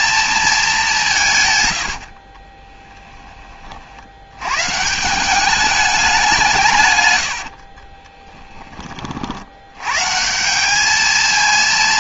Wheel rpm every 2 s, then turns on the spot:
190, 10, 140, 150, 20, 200.
2-4